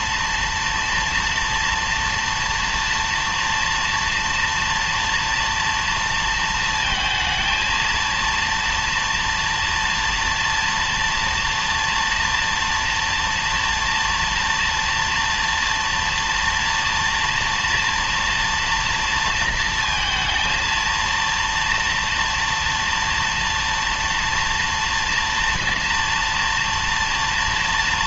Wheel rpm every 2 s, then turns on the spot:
230, 230, 230, 230, 230, 230, 240, 230, 230, 230, 230, 230, 230, 230.
none